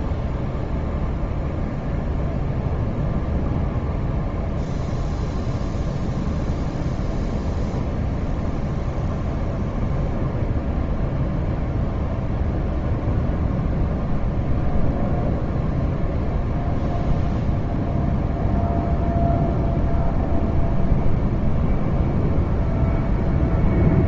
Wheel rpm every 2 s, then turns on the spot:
0, 0, 0, 0, 0, 0, 0, 0, 0, 0, 0, 0.
none